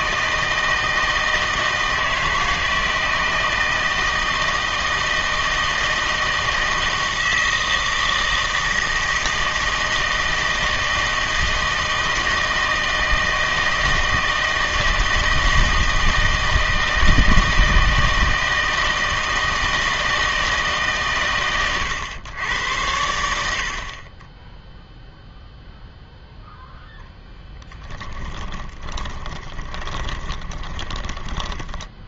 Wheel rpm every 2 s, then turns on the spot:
160, 160, 160, 160, 160, 160, 160, 160, 160, 160, 150, 100, 10, 0, 20, 20.
28-32